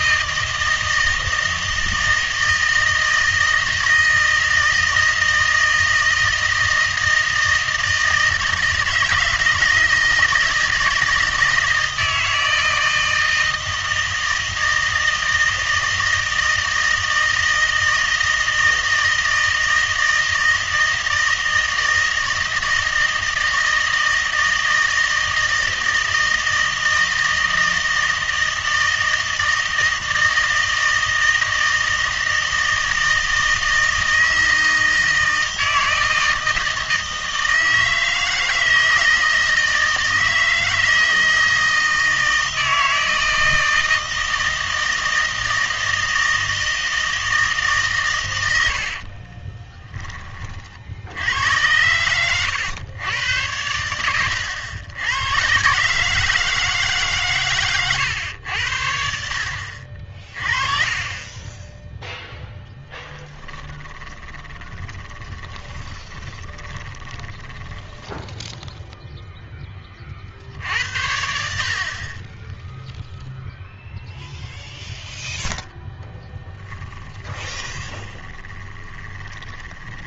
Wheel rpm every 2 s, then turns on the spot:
160, 160, 160, 160, 160, 160, 160, 160, 160, 160, 160, 160, 160, 160, 160, 160, 160, 160, 160, 160, 160, 160, 160, 160, 60, 60, 110, 100, 160, 70, 30, 10, 20, 10, 0, 80, 0, 0, 10, 30.
48-50 64-68 76-80